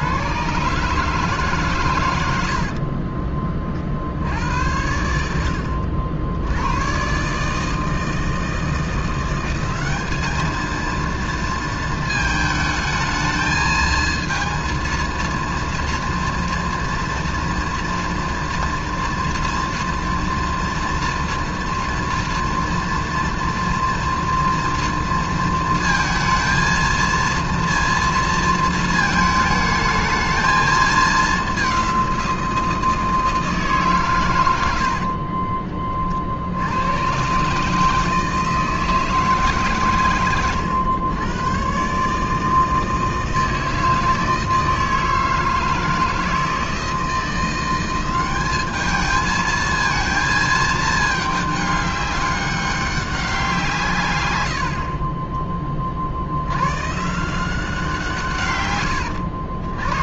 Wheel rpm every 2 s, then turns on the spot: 140, 70, 70, 80, 160, 220, 220, 230, 230, 230, 230, 230, 230, 230, 230, 220, 170, 90, 70, 160, 110, 160, 160, 160, 200, 220, 200, 80, 90, 120.
34-36 40-42